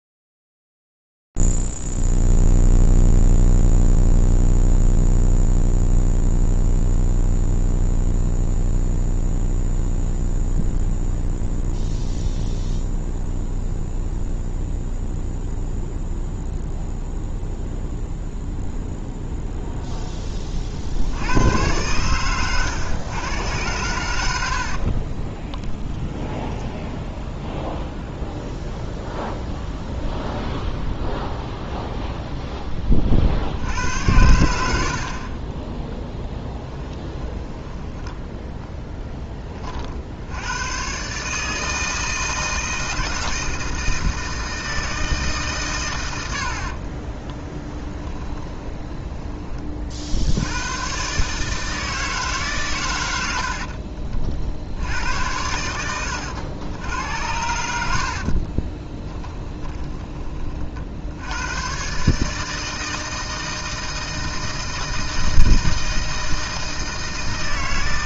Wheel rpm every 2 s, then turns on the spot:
0, 0, 0, 0, 0, 0, 0, 0, 0, 0, 20, 110, 70, 20, 0, 0, 10, 70, 10, 10, 100, 160, 160, 50, 20, 110, 130, 80, 90, 20, 40, 160, 160, 160.
24-28 36-40 48-50 58-60